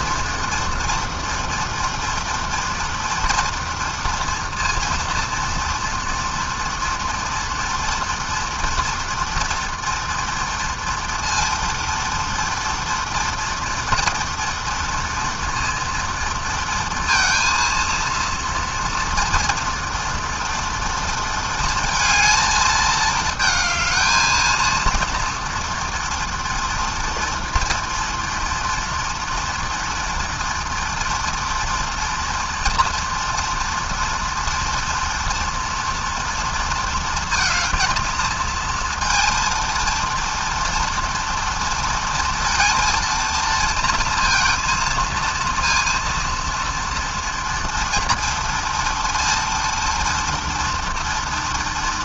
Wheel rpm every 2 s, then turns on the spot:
230, 230, 230, 230, 230, 230, 230, 230, 230, 230, 230, 220, 230, 230, 230, 240, 230, 240, 230, 230, 230, 230, 230, 240, 230, 230.
none